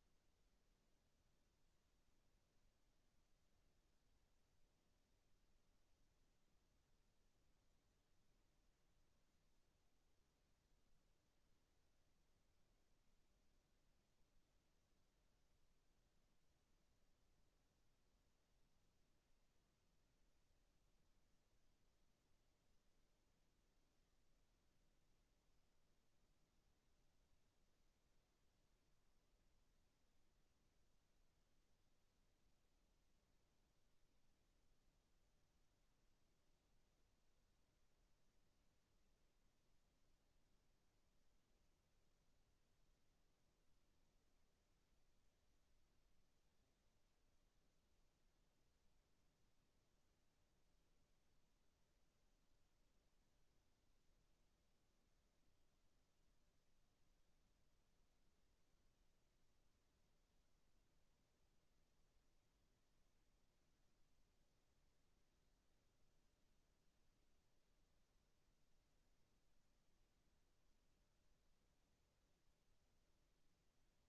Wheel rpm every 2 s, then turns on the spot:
0, 0, 0, 0, 0, 0, 0, 0, 0, 0, 0, 0, 0, 0, 0, 0, 0, 0, 0, 0, 0, 0, 0, 0, 0, 0, 0, 0, 0, 0, 0, 0, 0, 0, 0, 0, 0.
none